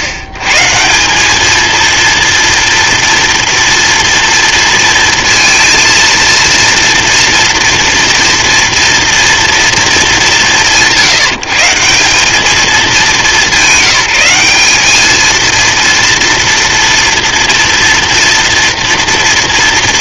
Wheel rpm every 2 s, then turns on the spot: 90, 230, 230, 230, 240, 170, 200, 190, 230, 230.
none